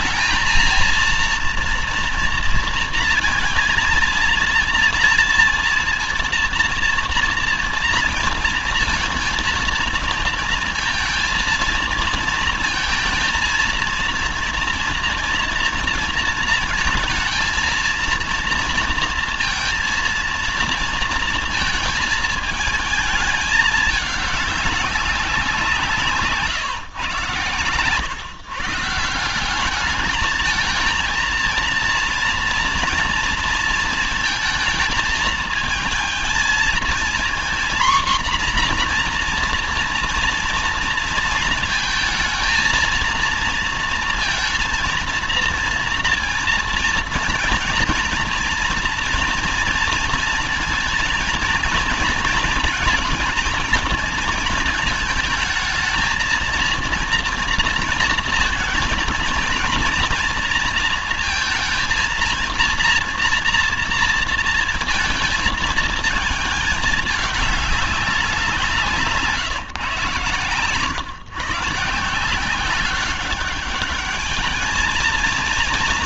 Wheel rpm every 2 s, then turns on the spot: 230, 230, 230, 230, 230, 230, 230, 230, 230, 230, 230, 220, 200, 140, 160, 230, 230, 220, 230, 240, 230, 220, 230, 230, 230, 230, 230, 220, 230, 230, 230, 230, 230, 220, 170, 120, 190, 220.
68-70